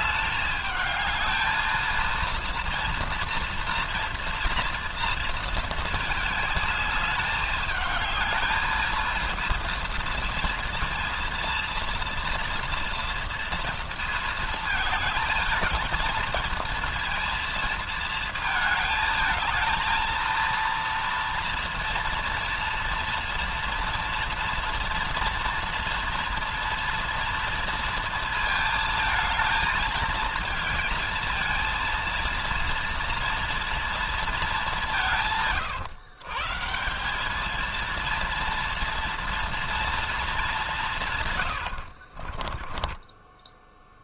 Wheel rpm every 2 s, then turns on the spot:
210, 230, 230, 220, 230, 230, 230, 220, 220, 220, 230, 230, 230, 230, 220, 220, 230, 180, 170, 230, 190, 30.
42-44